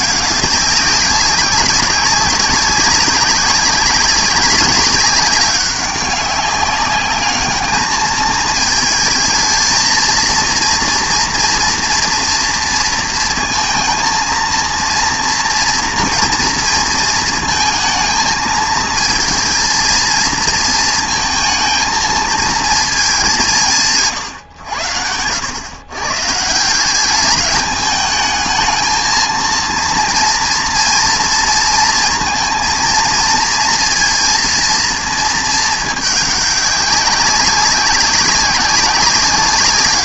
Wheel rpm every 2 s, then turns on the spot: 200, 200, 200, 200, 220, 230, 230, 230, 230, 220, 230, 220, 110, 160, 220, 230, 230, 230, 200, 200.
none